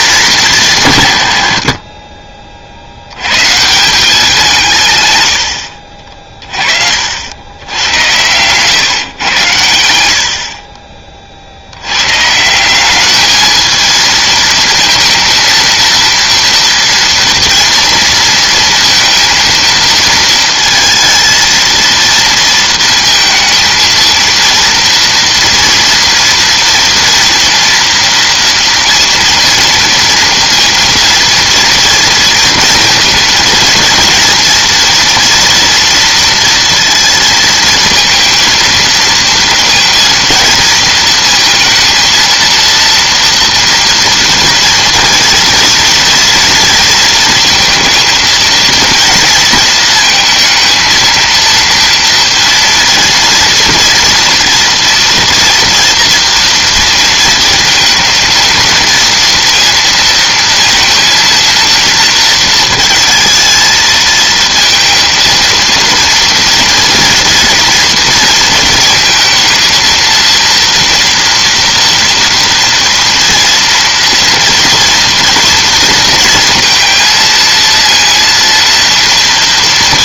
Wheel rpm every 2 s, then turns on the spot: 170, 60, 160, 40, 130, 40, 180, 230, 230, 230, 220, 230, 230, 230, 230, 230, 230, 230, 230, 230, 230, 230, 230, 230, 230, 220, 230, 230, 230, 230, 230, 220, 230, 230, 230, 230, 230, 240, 230, 230.
none